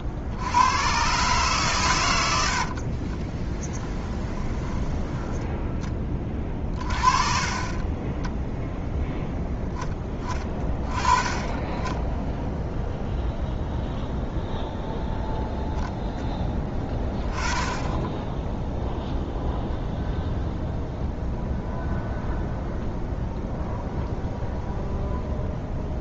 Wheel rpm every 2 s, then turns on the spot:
80, 70, 10, 30, 0, 20, 0, 0, 10, 0, 0, 0, 0.
2-4